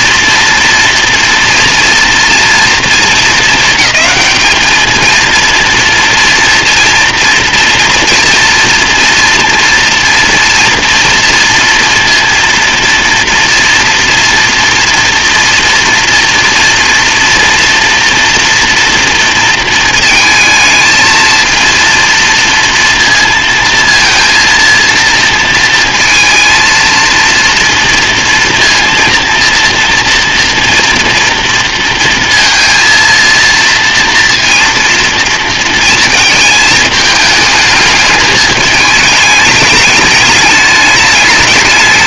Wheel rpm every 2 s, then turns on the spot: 230, 230, 220, 240, 240, 230, 230, 230, 230, 230, 220, 230, 230, 230, 230, 230, 230, 230, 220, 210, 210.
none